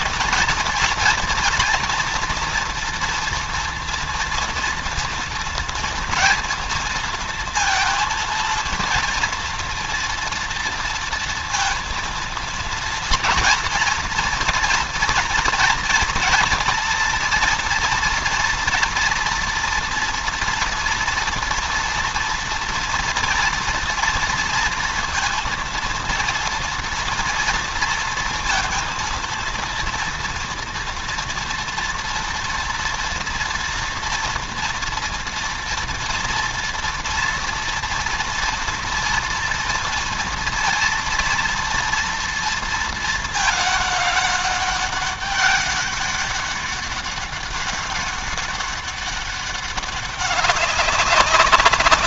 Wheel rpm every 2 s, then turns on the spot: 230, 230, 230, 230, 230, 230, 230, 240, 230, 230, 240, 240, 230, 230, 230, 230, 230, 240, 230, 230, 230, 220, 200, 200, 200, 190.
none